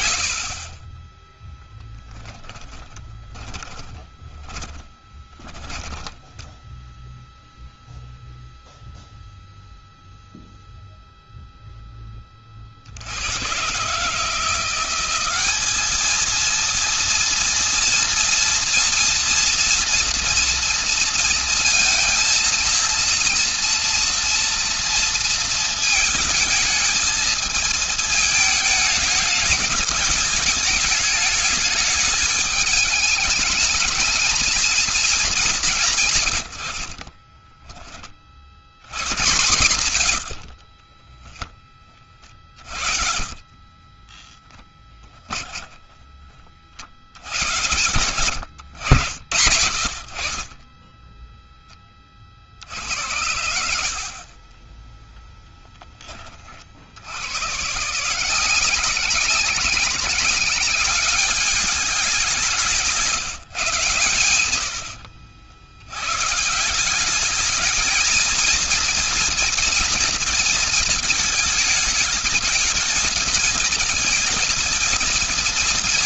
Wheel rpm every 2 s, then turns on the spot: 70, 10, 20, 10, 0, 0, 30, 170, 220, 230, 230, 230, 230, 220, 220, 210, 210, 220, 80, 70, 70, 40, 20, 40, 90, 40, 50, 40, 30, 170, 190, 190, 100, 150, 230, 230, 220, 230.
2-6 40-46